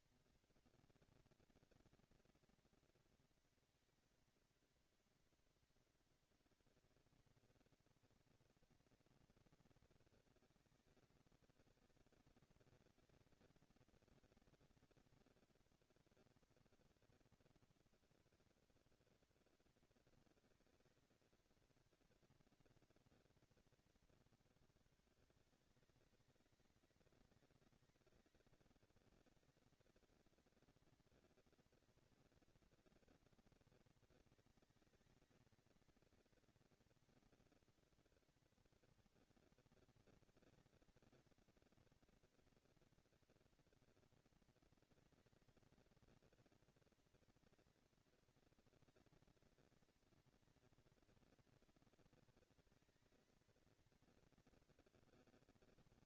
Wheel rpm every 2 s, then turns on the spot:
230, 230, 230, 230, 230, 230, 230, 230, 230, 230, 230, 230, 200, 190, 200, 230, 230, 220, 230, 230, 230, 240, 230, 230, 230, 230, 230, 230.
none